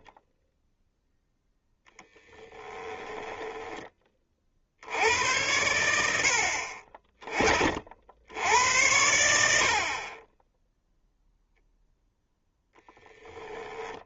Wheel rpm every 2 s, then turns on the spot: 0, 10, 120, 70, 100, 10, 0.
2-4